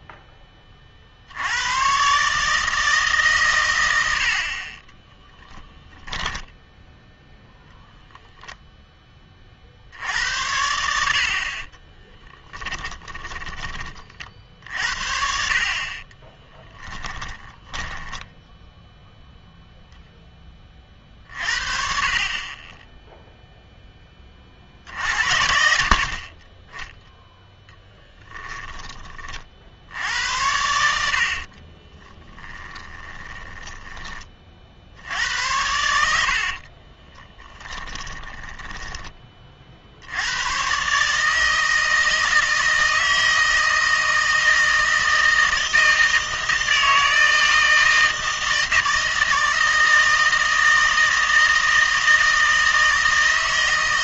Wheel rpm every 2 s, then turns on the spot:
30, 160, 40, 10, 0, 80, 20, 50, 10, 0, 30, 20, 50, 20, 10, 80, 10, 60, 30, 10, 130, 160, 160, 160, 160, 160, 160.
6-8 12-14 16-18 30-34 36-38